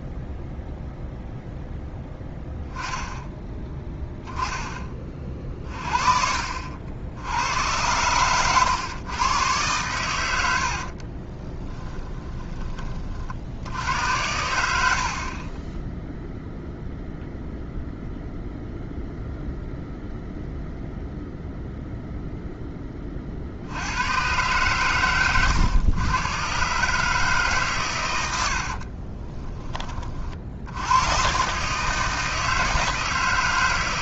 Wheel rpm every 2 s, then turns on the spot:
0, 0, 20, 70, 110, 70, 20, 70, 0, 0, 0, 20, 110, 140, 50, 90, 150.
10-12 28-30